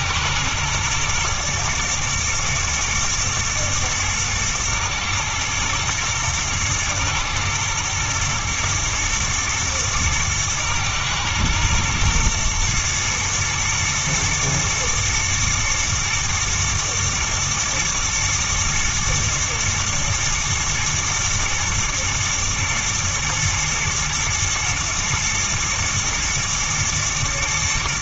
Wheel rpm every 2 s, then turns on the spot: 110, 110, 110, 110, 120, 110, 110, 120, 110, 120, 110, 120, 110, 120.
none